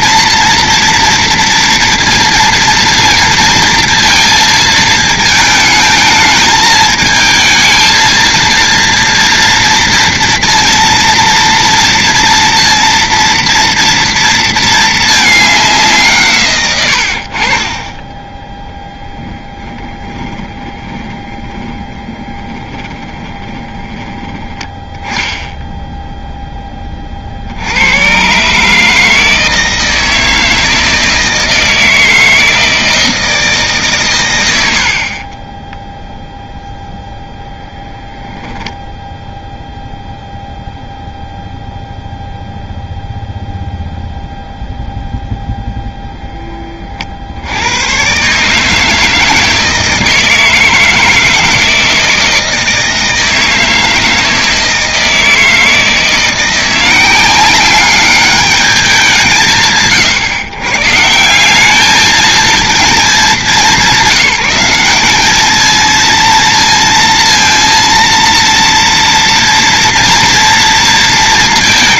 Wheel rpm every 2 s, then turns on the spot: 230, 230, 220, 220, 230, 240, 230, 230, 120, 10, 30, 20, 20, 10, 150, 160, 160, 80, 0, 0, 0, 0, 0, 20, 150, 160, 160, 160, 170, 200, 130, 210, 190, 230, 230, 230.
16-18 20-24